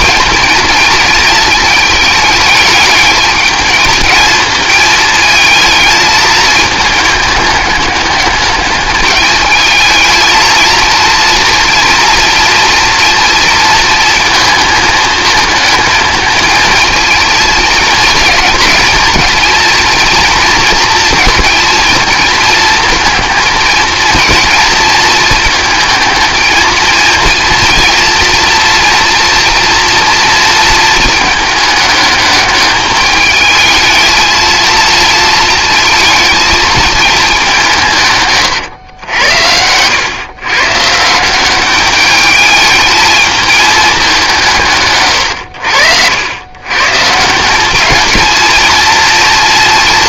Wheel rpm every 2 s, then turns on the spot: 220, 210, 220, 210, 210, 230, 230, 220, 230, 230, 230, 220, 230, 230, 240, 220, 210, 230, 220, 110, 140, 220, 150, 130, 230.
none